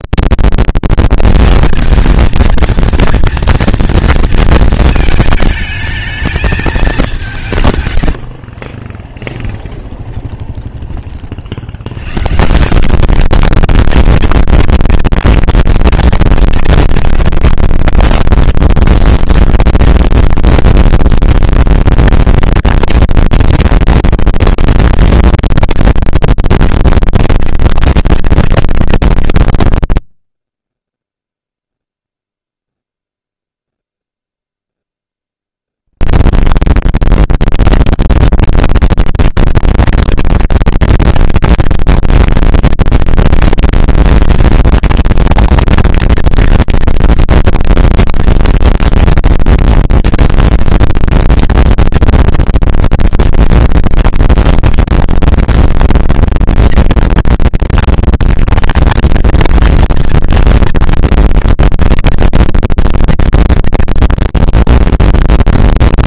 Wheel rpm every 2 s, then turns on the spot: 230, 230, 230, 220, 60, 20, 150, 210, 200, 200, 230, 230, 220, 200, 190, 30, 0, 0, 130, 210, 220, 220, 230, 230, 230, 230, 230, 230, 230, 230, 230, 240, 230.
8-12